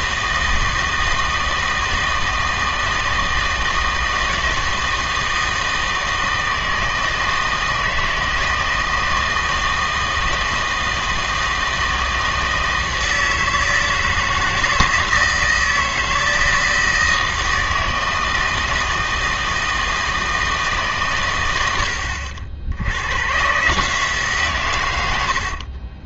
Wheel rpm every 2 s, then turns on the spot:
160, 160, 160, 160, 160, 160, 160, 160, 160, 160, 150, 90, 110.
none